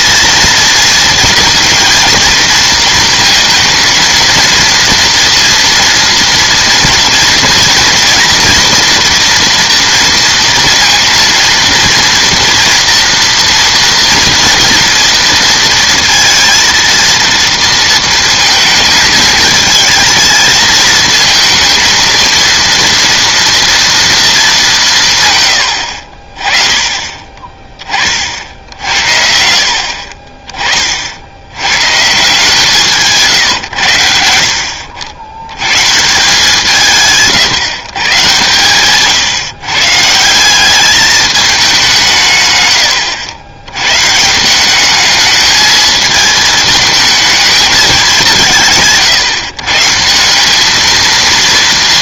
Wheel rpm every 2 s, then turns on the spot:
230, 230, 230, 230, 240, 230, 230, 230, 230, 220, 220, 230, 140, 30, 70, 50, 150, 70, 160, 130, 210, 100, 200, 220, 150, 220.
38-40